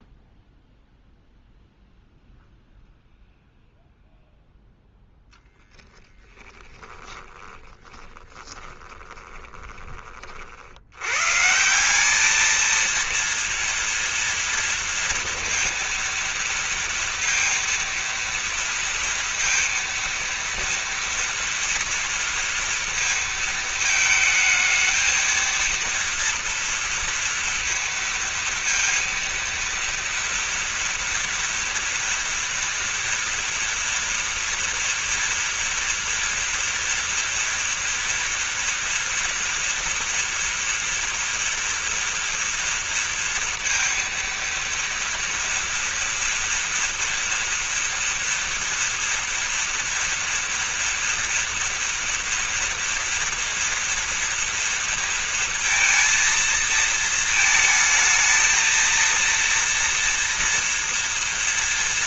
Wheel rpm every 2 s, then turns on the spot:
0, 0, 10, 20, 20, 80, 220, 230, 230, 230, 230, 230, 220, 230, 230, 230, 230, 230, 240, 230, 230, 230, 230, 230, 230, 240, 230, 230, 230, 230, 240.
4-10